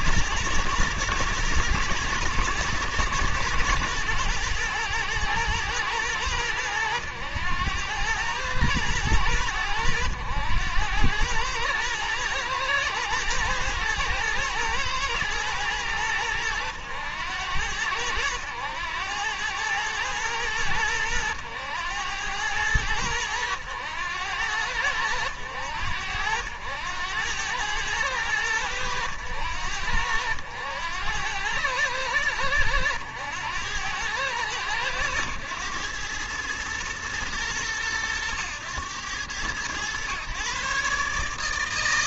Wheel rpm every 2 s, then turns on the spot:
110, 120, 110, 110, 110, 100, 110, 120, 100, 90, 100, 100, 90, 90, 100, 90, 90, 110, 110, 100, 140.
none